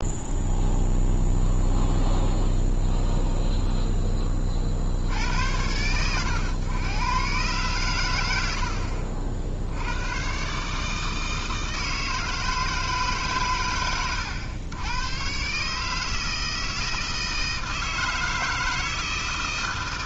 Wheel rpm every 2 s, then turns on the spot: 0, 0, 50, 110, 80, 140, 160, 100, 160, 160.
none